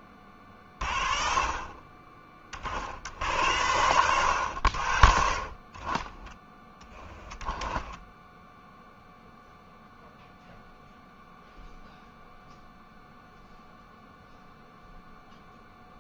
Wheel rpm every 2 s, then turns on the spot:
40, 60, 60, 10, 0, 0, 0, 0.
none